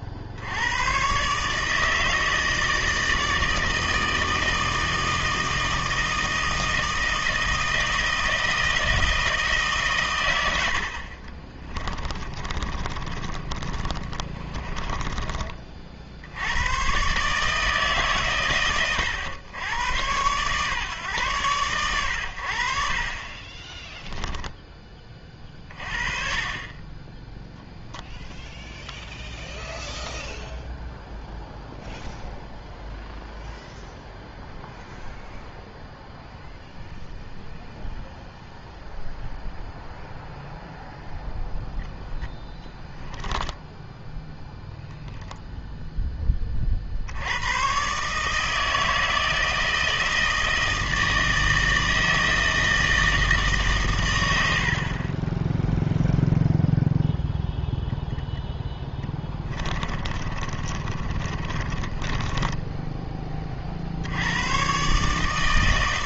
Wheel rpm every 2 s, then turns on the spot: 80, 160, 160, 160, 160, 90, 30, 30, 90, 120, 130, 70, 10, 20, 0, 0, 0, 0, 0, 0, 0, 10, 0, 40, 160, 160, 160, 80, 0, 10, 30, 10, 120.
12-16 42-44 60-64